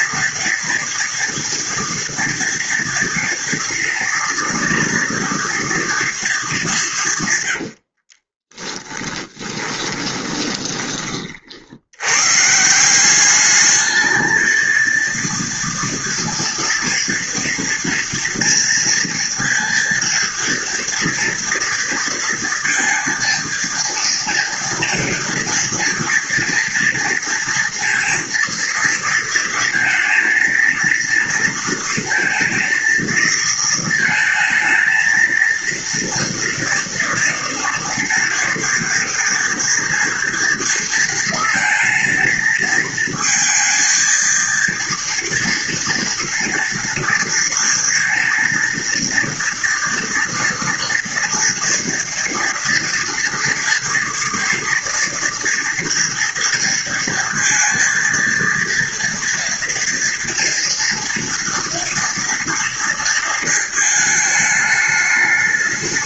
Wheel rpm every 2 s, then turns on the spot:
230, 230, 240, 210, 20, 20, 160, 230, 230, 230, 230, 230, 230, 230, 230, 230, 230, 220, 230, 230, 230, 230, 230, 230, 230, 230, 230, 230, 230, 230, 230, 230, 210.
8-10